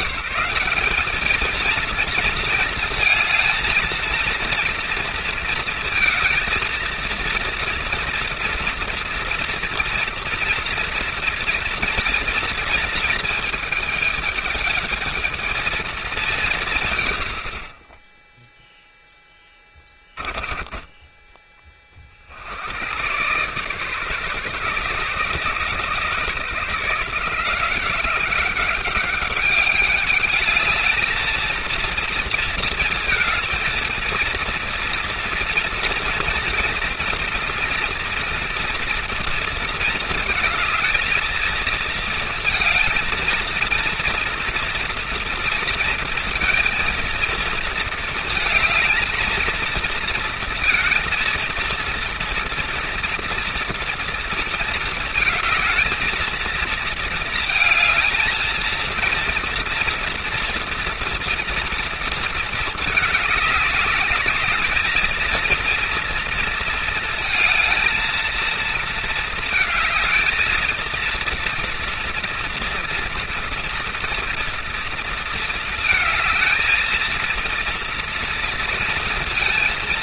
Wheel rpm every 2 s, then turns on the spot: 190, 230, 230, 230, 230, 230, 230, 220, 160, 0, 10, 80, 140, 150, 190, 210, 230, 230, 230, 240, 220, 230, 230, 230, 230, 230, 230, 230, 230, 230, 230, 220, 210, 230, 230, 230, 240, 230, 220, 230.
20-22